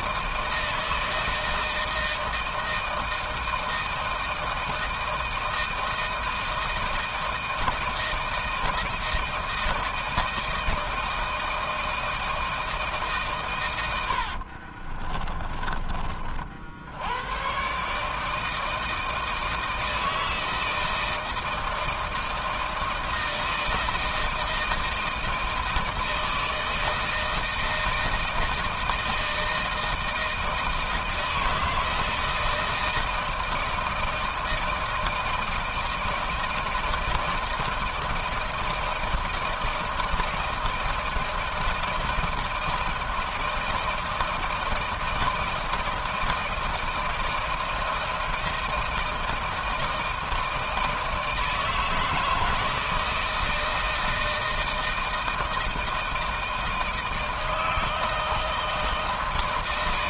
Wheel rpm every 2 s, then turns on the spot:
160, 160, 160, 160, 160, 160, 160, 60, 50, 150, 160, 160, 160, 160, 160, 160, 160, 160, 160, 160, 160, 160, 160, 160, 160, 160, 160, 160, 160, 160.
14-16